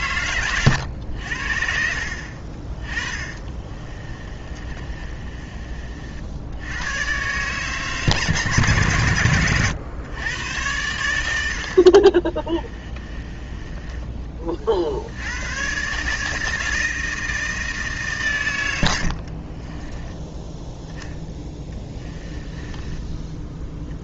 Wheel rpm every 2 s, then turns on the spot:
100, 40, 30, 100, 130, 100, 20, 60, 160, 90, 10, 10.
2-6 12-14 22-24